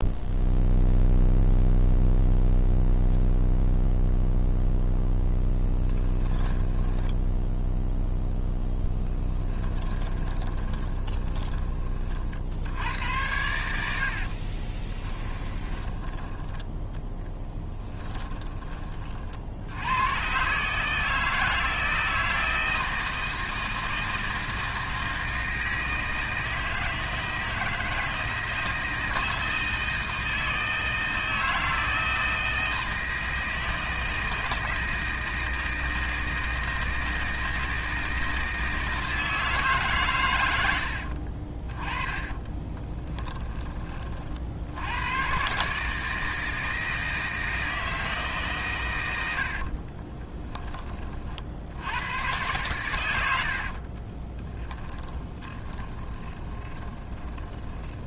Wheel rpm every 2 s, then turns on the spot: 0, 0, 0, 10, 10, 20, 80, 30, 10, 20, 150, 160, 160, 160, 160, 160, 160, 160, 160, 160, 80, 10, 80, 160, 110, 20, 110, 20, 20.
6-12 14-18 42-44 54-58